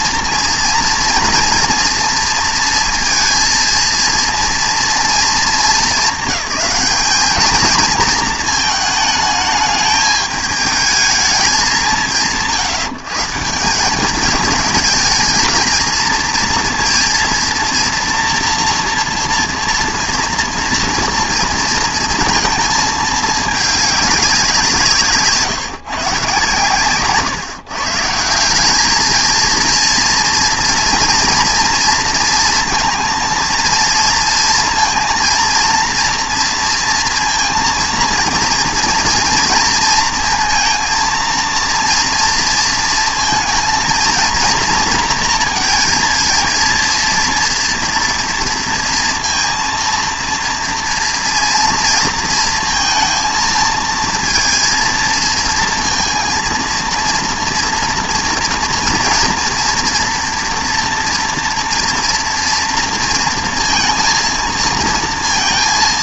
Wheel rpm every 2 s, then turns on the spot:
230, 230, 230, 220, 230, 210, 160, 220, 230, 230, 230, 220, 180, 140, 190, 240, 230, 230, 230, 230, 230, 230, 230, 230, 230, 230, 220, 230, 230, 230, 230, 230, 230.
none